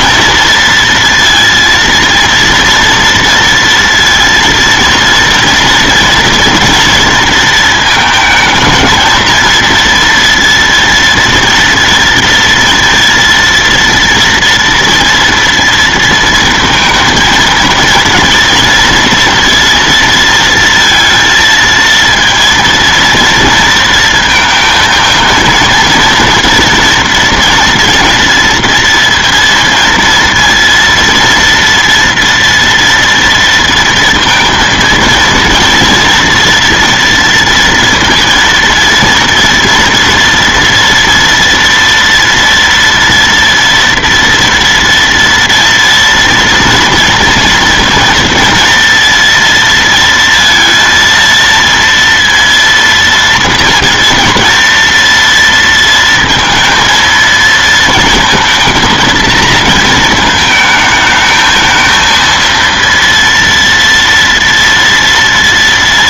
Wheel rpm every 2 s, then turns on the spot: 230, 230, 230, 230, 220, 230, 230, 230, 230, 230, 230, 230, 220, 230, 230, 230, 230, 220, 230, 230, 230, 230, 230, 230, 230, 230, 230, 230, 230, 230, 220, 230, 230.
none